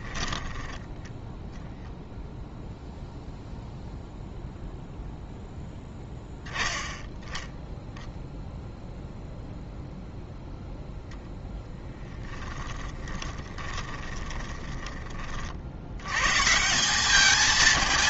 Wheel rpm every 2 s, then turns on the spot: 10, 0, 0, 10, 0, 0, 30, 20, 180.
0-2 12-16